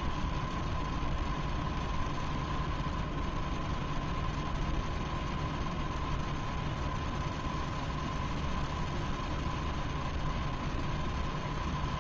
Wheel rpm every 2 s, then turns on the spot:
0, 0, 0, 0, 0, 0.
none